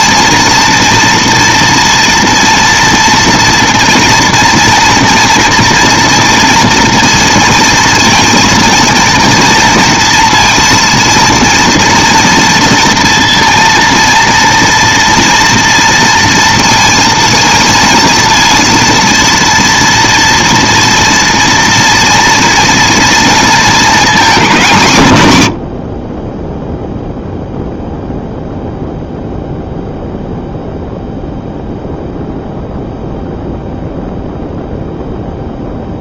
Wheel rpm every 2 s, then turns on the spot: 230, 230, 240, 230, 230, 230, 230, 240, 230, 230, 230, 230, 190, 0, 0, 0, 0, 0.
none